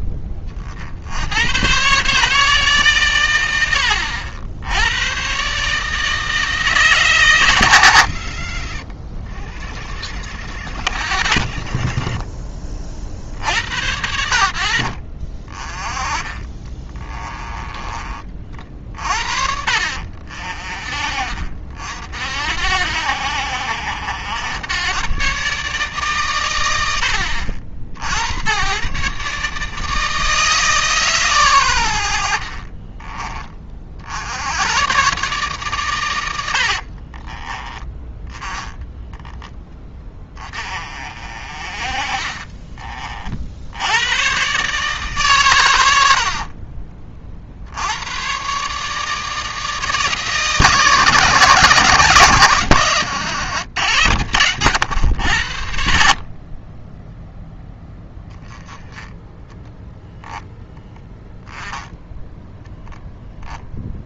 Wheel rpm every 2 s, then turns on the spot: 50, 140, 90, 150, 70, 90, 50, 60, 20, 40, 40, 80, 110, 90, 110, 150, 40, 110, 70, 10, 30, 30, 140, 40, 140, 150, 130, 120, 30, 10, 0, 10.
8-10 16-18 32-34 36-40 42-44 46-48 62-64